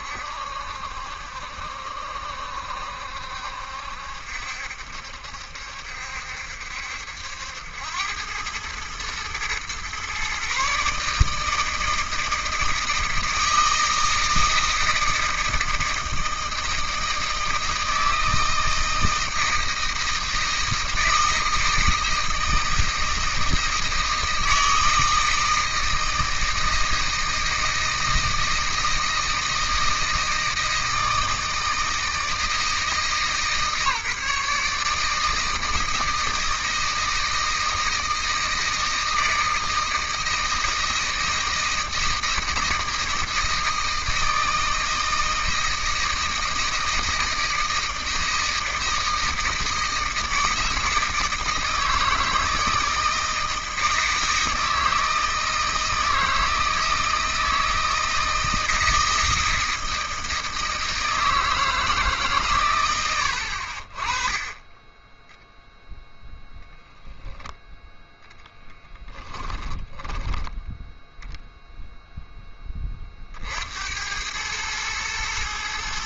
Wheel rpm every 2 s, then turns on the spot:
70, 70, 70, 70, 100, 140, 160, 160, 160, 160, 160, 160, 160, 160, 160, 160, 160, 150, 160, 160, 160, 160, 160, 160, 160, 160, 160, 160, 160, 160, 160, 120, 20, 0, 10, 10, 10, 100.
none